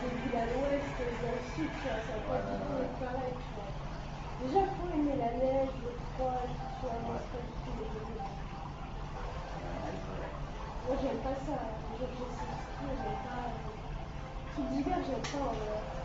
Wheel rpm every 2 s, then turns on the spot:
0, 0, 0, 0, 0, 0, 0, 0.
none